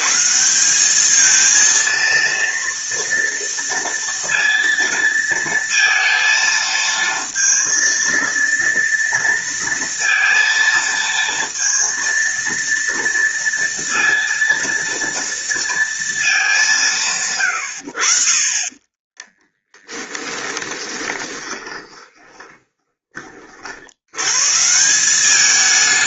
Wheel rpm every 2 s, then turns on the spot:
190, 230, 230, 230, 230, 230, 230, 230, 180, 20, 20, 20, 170.
18-24